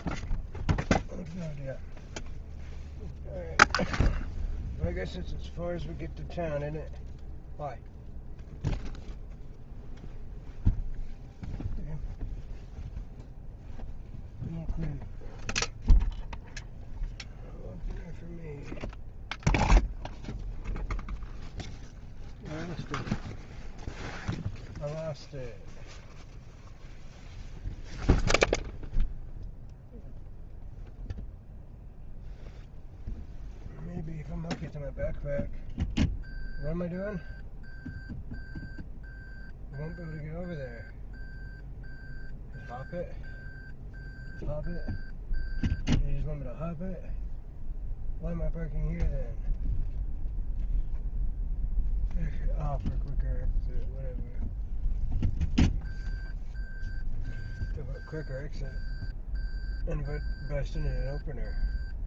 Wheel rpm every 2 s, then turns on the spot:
0, 0, 0, 0, 0, 0, 0, 0, 0, 0, 0, 0, 0, 0, 0, 0, 0, 0, 0, 0, 0, 0, 0, 0, 0, 0, 0, 0, 0, 0, 0.
none